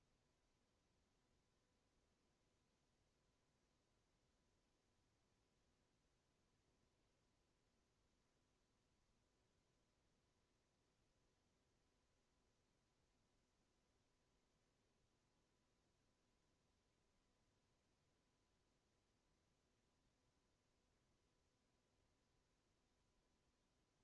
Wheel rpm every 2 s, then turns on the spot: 0, 0, 0, 0, 0, 0, 0, 0, 0, 0, 0, 0.
none